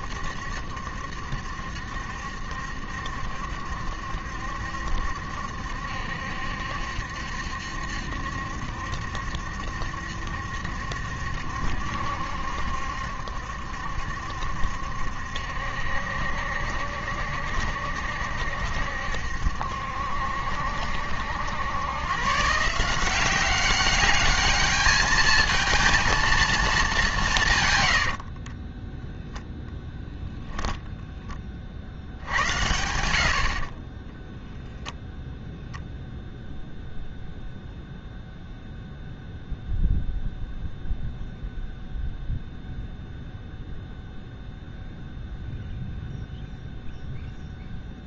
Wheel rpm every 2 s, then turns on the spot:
70, 70, 70, 70, 70, 70, 70, 70, 70, 70, 70, 170, 210, 210, 10, 0, 80, 0, 0, 0, 0, 0, 0, 0.
28-30